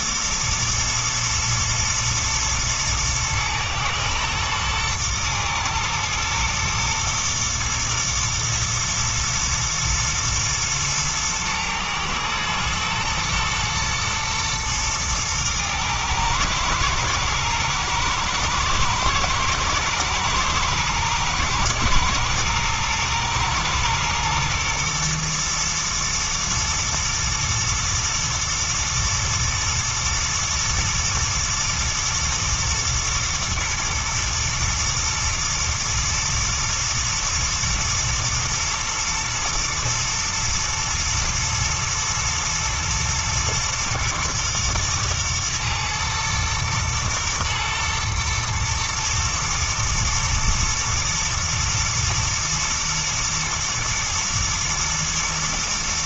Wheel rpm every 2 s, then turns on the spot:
120, 110, 120, 120, 110, 110, 110, 110, 110, 110, 120, 120, 120, 110, 120, 120, 110, 110, 120, 120, 110, 110, 120, 110, 110, 110, 120, 120.
none